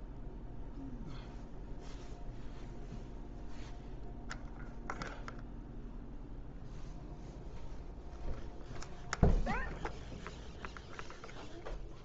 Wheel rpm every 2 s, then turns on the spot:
0, 0, 0, 0, 0, 0.
none